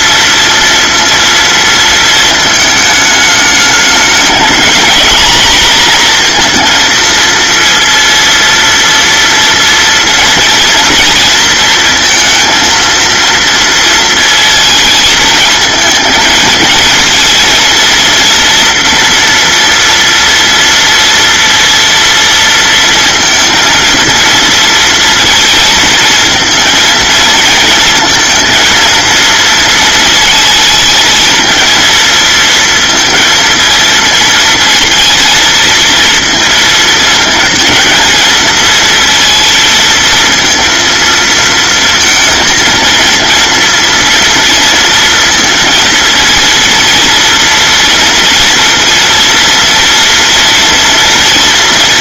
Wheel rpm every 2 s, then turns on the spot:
230, 220, 220, 230, 240, 230, 230, 220, 220, 240, 230, 230, 220, 230, 230, 220, 230, 230, 230, 230, 230, 230, 230, 230, 230, 230.
none